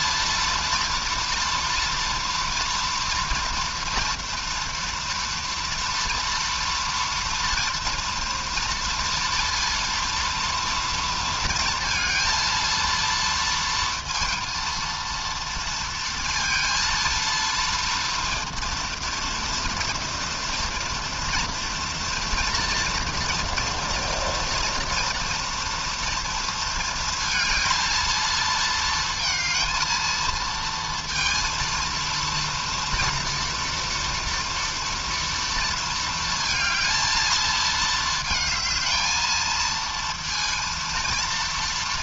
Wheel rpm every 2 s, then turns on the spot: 230, 230, 230, 230, 230, 230, 230, 230, 230, 230, 230, 230, 240, 230, 220, 230, 230, 230, 220, 220, 230.
none